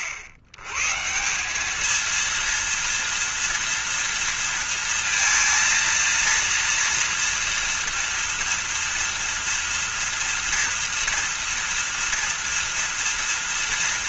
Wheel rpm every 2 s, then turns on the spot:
110, 230, 230, 230, 240, 230, 230.
none